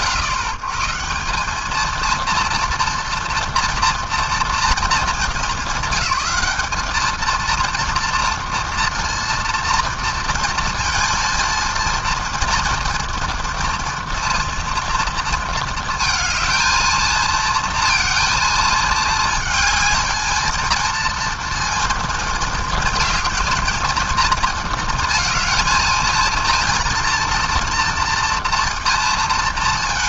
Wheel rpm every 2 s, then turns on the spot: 120, 240, 230, 210, 230, 230, 230, 230, 220, 220, 230, 230, 230, 230, 230.
none